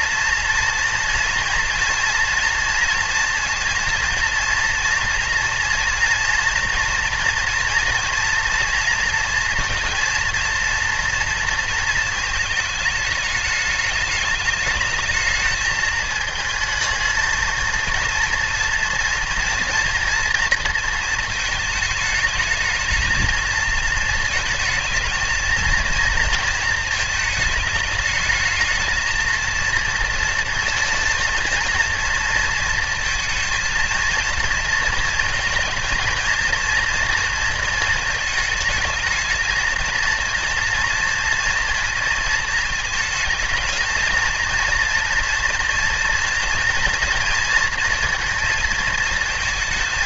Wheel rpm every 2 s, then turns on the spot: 230, 240, 230, 230, 230, 230, 220, 210, 220, 230, 220, 220, 220, 230, 220, 230, 230, 230, 230, 220, 230, 220, 230, 230, 230.
none